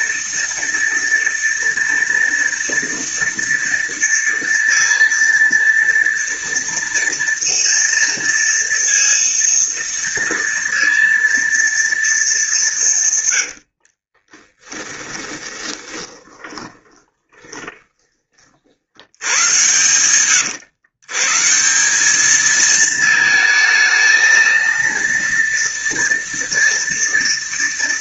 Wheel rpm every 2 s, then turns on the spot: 230, 230, 230, 230, 230, 230, 140, 20, 20, 80, 120, 220, 230, 230.
14-18